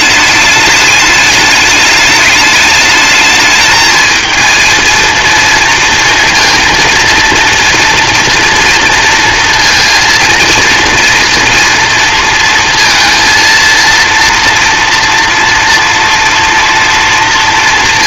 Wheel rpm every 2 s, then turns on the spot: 210, 210, 230, 230, 240, 230, 230, 240, 230.
none